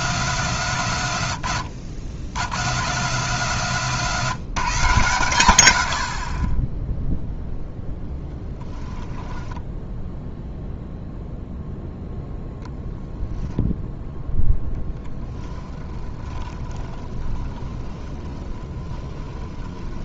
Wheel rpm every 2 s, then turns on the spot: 150, 120, 150, 10, 10, 0, 0, 10, 30, 20.
8-10 14-20